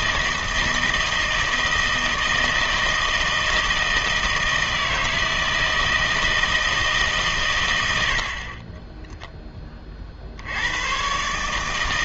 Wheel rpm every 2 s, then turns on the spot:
160, 160, 160, 160, 30, 110.
none